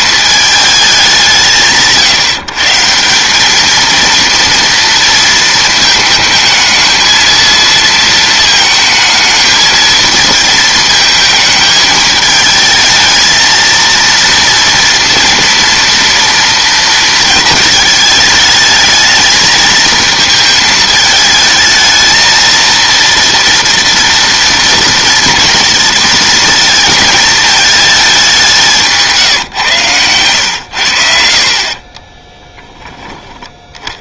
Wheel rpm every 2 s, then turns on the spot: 210, 150, 230, 220, 220, 230, 220, 230, 230, 210, 220, 230, 230, 230, 190, 110, 10.
none